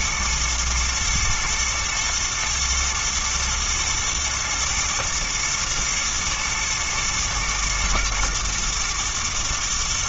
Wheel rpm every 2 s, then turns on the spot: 110, 110, 110, 110, 120.
none